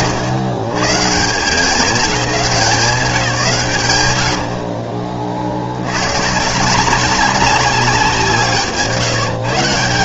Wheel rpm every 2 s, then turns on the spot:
120, 160, 40, 170, 140.
none